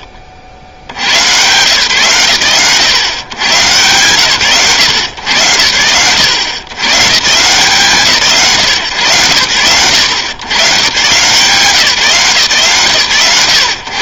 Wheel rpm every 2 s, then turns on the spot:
90, 120, 110, 130, 100, 160, 130.
none